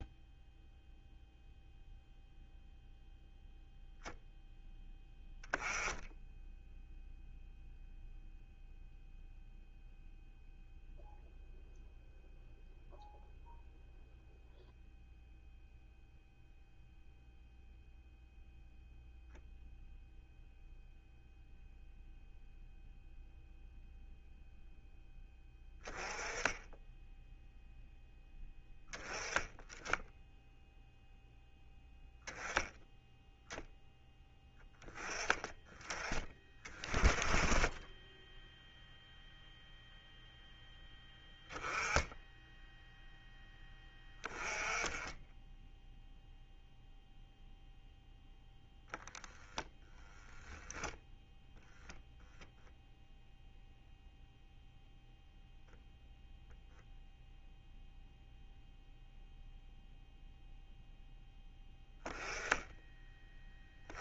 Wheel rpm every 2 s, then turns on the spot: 0, 0, 0, 0, 0, 0, 0, 0, 0, 0, 0, 0, 0, 10, 10, 0, 0, 10, 30, 0, 10, 0, 10, 0, 10, 0, 0, 0, 0, 0, 0, 10.
none